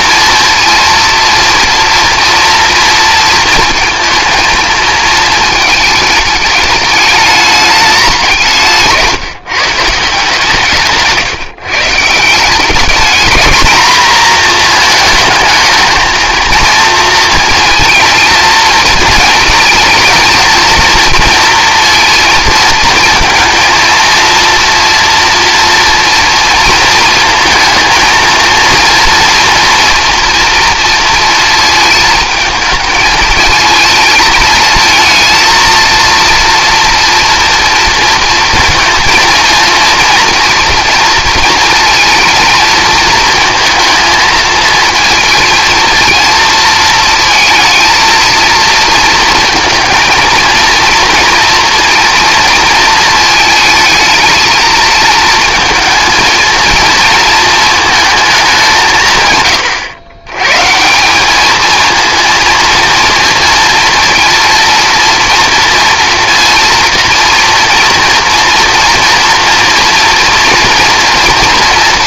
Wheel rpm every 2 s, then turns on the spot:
230, 230, 230, 210, 170, 150, 170, 230, 230, 220, 220, 230, 230, 230, 230, 230, 220, 220, 230, 230, 230, 220, 220, 230, 220, 230, 230, 220, 230, 190, 120, 230, 230, 230, 230, 230.
none